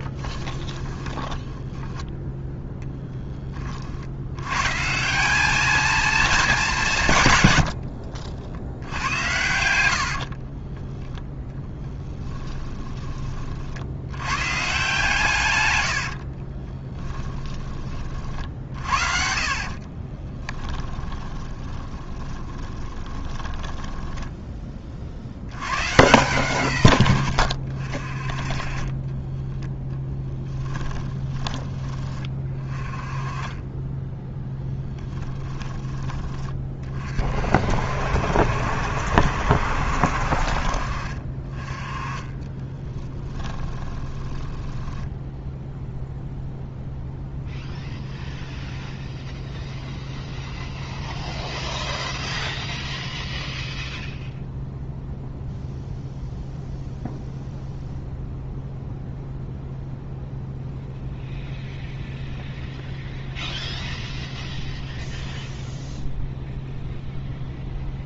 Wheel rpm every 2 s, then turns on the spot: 10, 0, 150, 180, 70, 30, 20, 140, 30, 60, 20, 20, 20, 100, 20, 10, 20, 20, 30, 70, 40, 20, 10, 0, 0, 0, 0, 0, 0, 0, 0, 0, 0, 0.
0-2 10-12 16-24 30-32 34-36 40-46